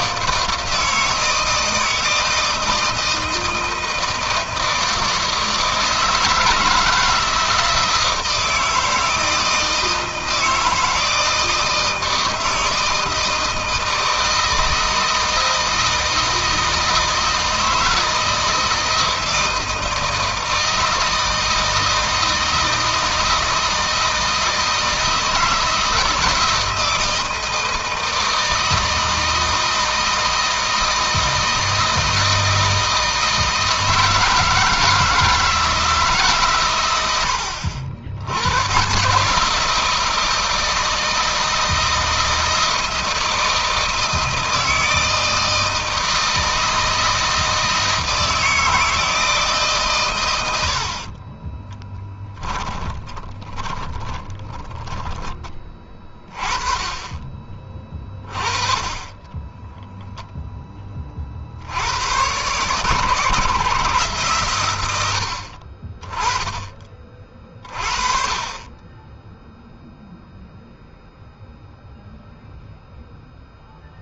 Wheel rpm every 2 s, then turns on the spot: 160, 160, 160, 160, 160, 160, 160, 160, 160, 160, 160, 160, 160, 160, 160, 160, 160, 160, 130, 110, 160, 160, 160, 160, 160, 90, 20, 20, 20, 30, 10, 120, 120, 20, 20, 0, 0.
52-56